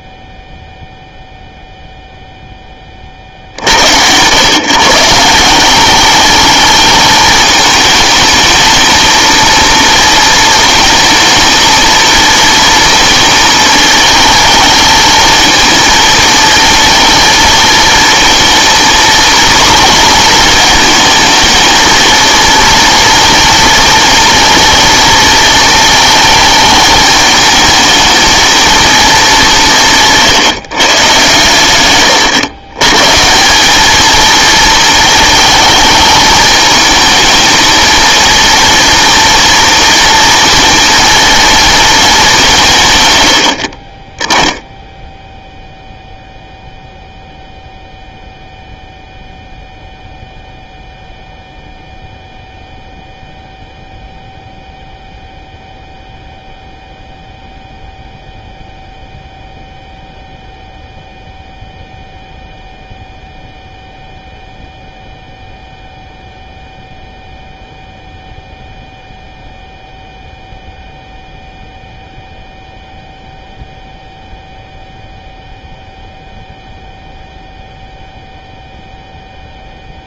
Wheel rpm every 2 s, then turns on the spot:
0, 10, 130, 210, 220, 230, 230, 220, 230, 230, 230, 230, 230, 220, 220, 160, 120, 230, 220, 240, 230, 170, 10, 0, 0, 0, 0, 0, 0, 0, 0, 0, 0, 0, 0, 0, 0, 0, 0, 0.
none